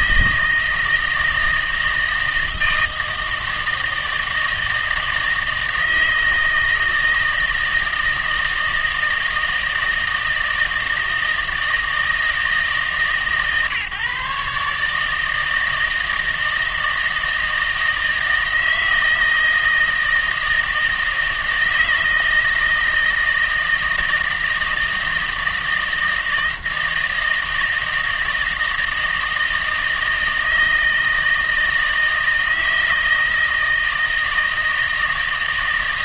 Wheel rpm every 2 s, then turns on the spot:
160, 160, 160, 160, 160, 160, 150, 150, 160, 160, 160, 160, 160, 160, 160, 160, 160, 160.
none